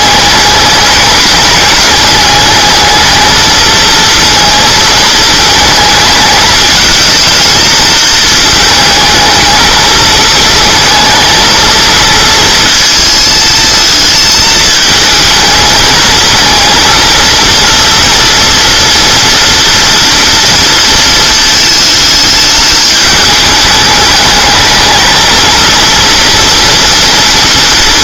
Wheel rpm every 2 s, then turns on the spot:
210, 210, 220, 220, 220, 220, 230, 220, 230, 240, 230, 210, 210, 230.
none